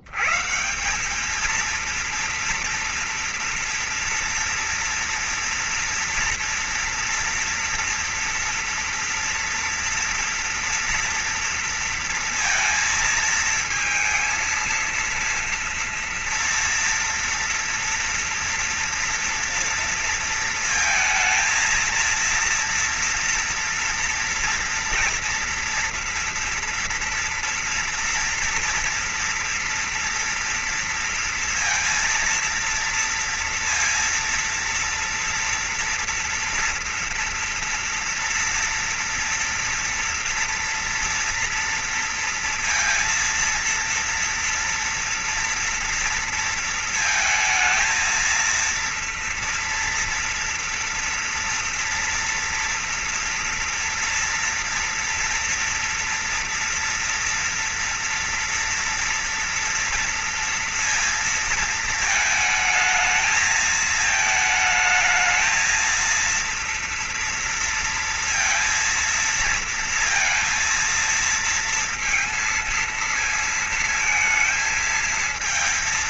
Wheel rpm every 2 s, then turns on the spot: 190, 230, 230, 230, 230, 230, 230, 230, 230, 230, 230, 230, 230, 230, 230, 230, 230, 230, 240, 230, 230, 230, 240, 220, 230, 240, 240, 230, 230, 230, 230, 220, 220, 230, 230, 230, 230, 220.
none